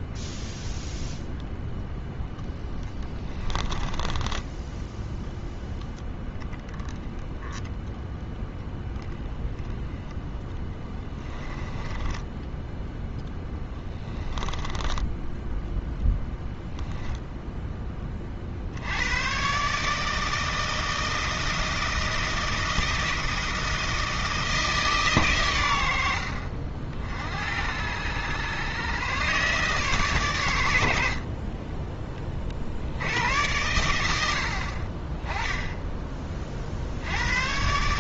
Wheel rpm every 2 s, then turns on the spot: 0, 10, 10, 0, 10, 10, 10, 10, 0, 70, 160, 170, 150, 60, 120, 80, 70, 40, 60.
2-6 10-12 14-16